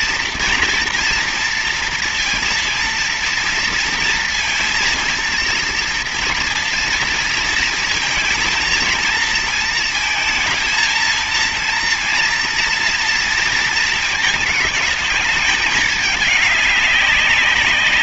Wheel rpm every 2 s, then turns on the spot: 230, 230, 230, 230, 230, 220, 230, 220, 210.
none